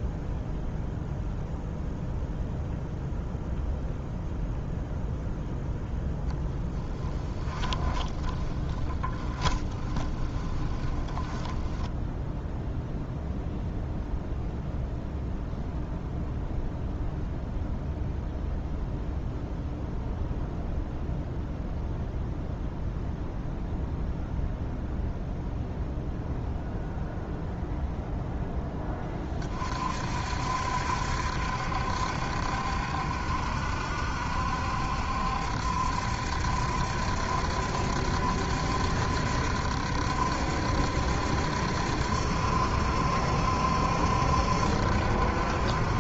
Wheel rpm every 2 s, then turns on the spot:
0, 0, 0, 10, 20, 20, 0, 0, 0, 0, 0, 0, 0, 0, 10, 60, 70, 70, 70, 70, 70, 70, 70.
6-12